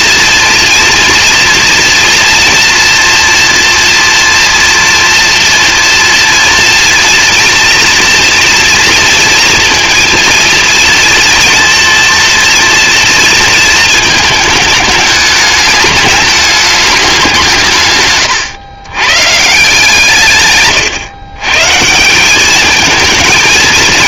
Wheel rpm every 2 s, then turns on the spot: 230, 230, 230, 230, 230, 230, 230, 210, 200, 120, 130, 220.
none